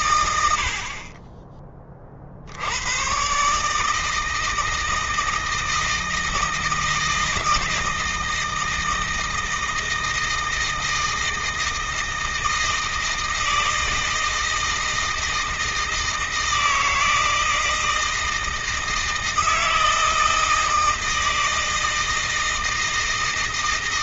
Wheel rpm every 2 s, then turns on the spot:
50, 100, 160, 160, 160, 160, 160, 160, 160, 160, 160, 160.
none